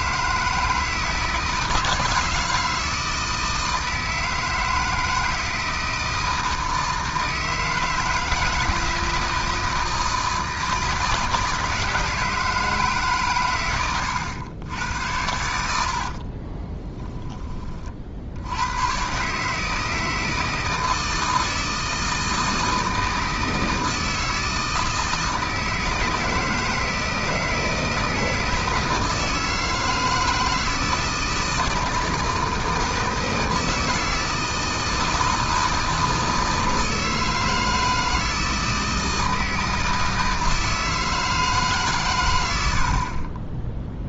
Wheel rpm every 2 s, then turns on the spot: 160, 160, 160, 160, 160, 160, 150, 100, 20, 100, 160, 160, 160, 160, 160, 160, 160, 160, 160, 160, 160, 80.
16-18